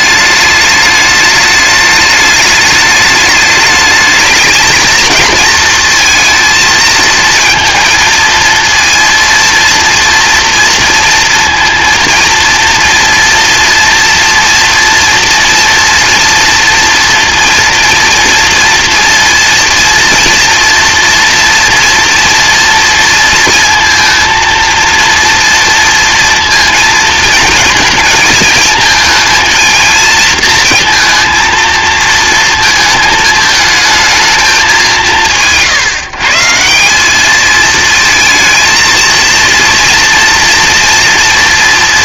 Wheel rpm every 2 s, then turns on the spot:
210, 210, 220, 230, 230, 230, 230, 230, 230, 230, 230, 230, 230, 230, 220, 230, 230, 200, 170, 230, 230.
none